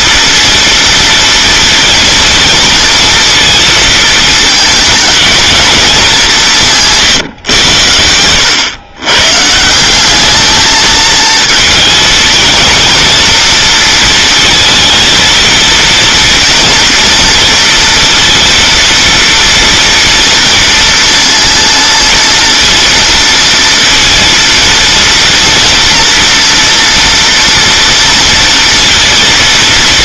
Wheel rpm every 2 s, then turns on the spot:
230, 230, 220, 150, 120, 220, 230, 230, 230, 230, 230, 230, 230, 230, 230.
6-8